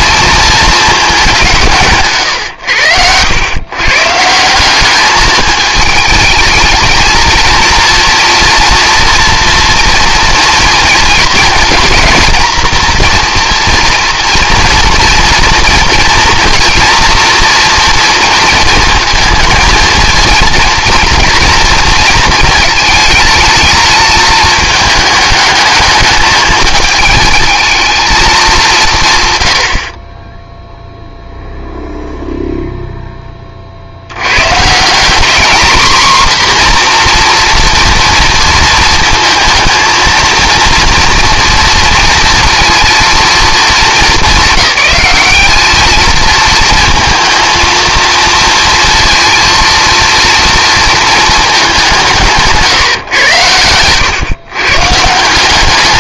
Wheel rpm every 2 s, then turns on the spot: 220, 110, 190, 220, 230, 230, 230, 240, 240, 230, 230, 220, 220, 220, 180, 0, 0, 130, 250, 230, 230, 230, 210, 220, 230, 230, 150, 130.
2-4